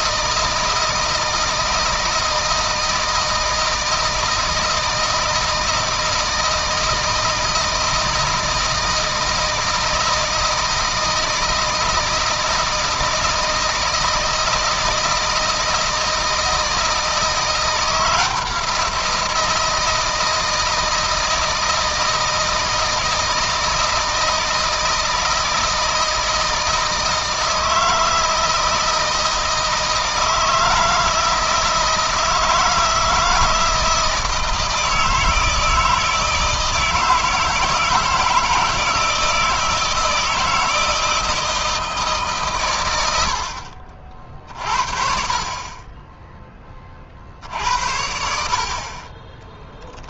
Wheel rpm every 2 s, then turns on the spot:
160, 160, 160, 160, 160, 160, 160, 160, 160, 170, 160, 160, 160, 160, 160, 160, 160, 160, 160, 160, 160, 110, 40, 30, 50.
none